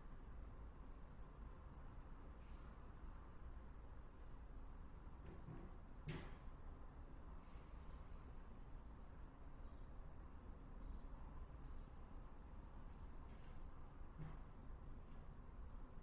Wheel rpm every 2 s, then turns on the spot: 0, 0, 0, 0, 0, 0, 0, 0.
none